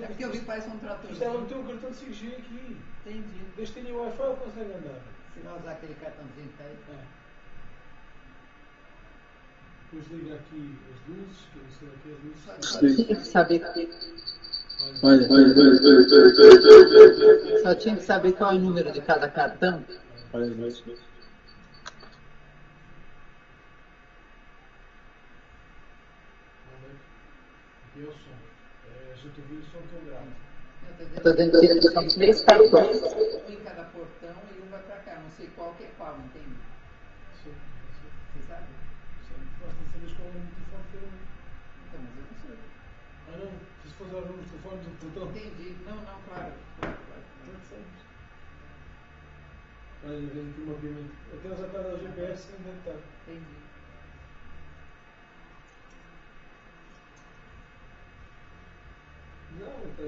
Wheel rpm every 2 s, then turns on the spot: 0, 0, 0, 0, 0, 0, 0, 0, 0, 0, 0, 0, 0, 0, 0, 0, 0, 0, 0, 0, 0, 0, 0, 0, 0, 0, 0, 0, 0, 0.
none